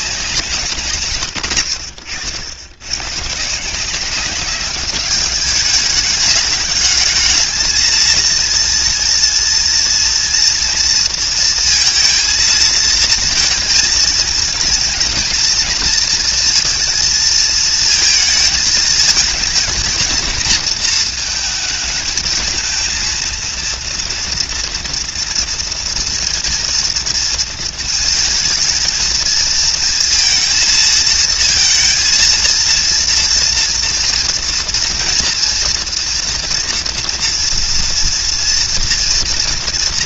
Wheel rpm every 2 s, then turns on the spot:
170, 90, 200, 210, 230, 230, 220, 230, 230, 220, 230, 230, 230, 230, 220, 230, 230, 230, 230, 230.
none